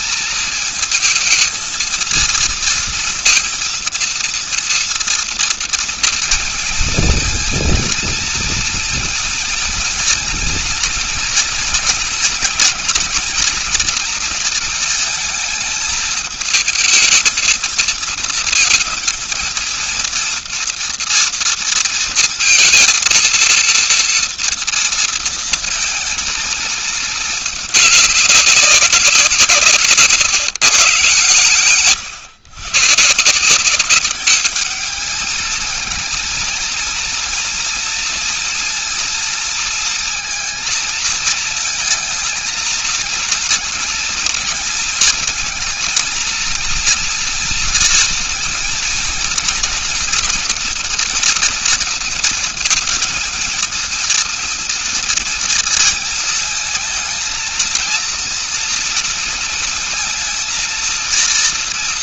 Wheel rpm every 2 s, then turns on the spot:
230, 230, 230, 230, 230, 230, 230, 230, 220, 220, 230, 230, 230, 230, 200, 150, 130, 210, 230, 230, 230, 230, 220, 230, 230, 240, 220, 230, 220, 230, 230.
none